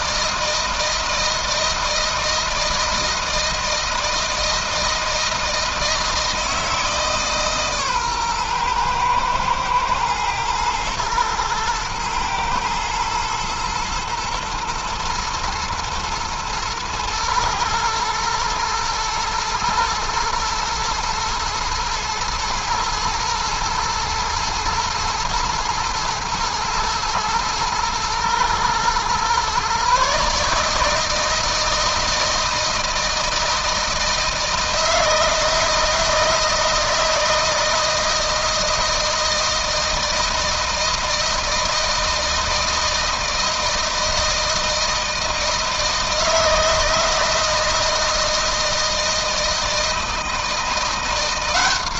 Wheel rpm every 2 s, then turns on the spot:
160, 160, 160, 160, 120, 110, 120, 120, 110, 110, 110, 110, 110, 110, 120, 150, 160, 160, 160, 160, 160, 160, 160, 160, 160, 170.
none